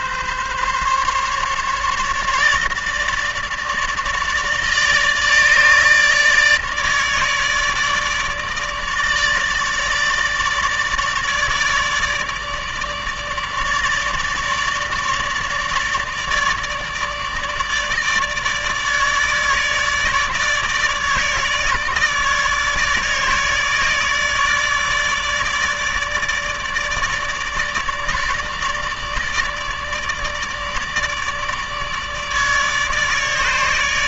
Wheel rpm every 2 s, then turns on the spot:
140, 150, 150, 150, 150, 150, 150, 150, 150, 150, 150, 150, 150, 150, 150, 150, 150.
none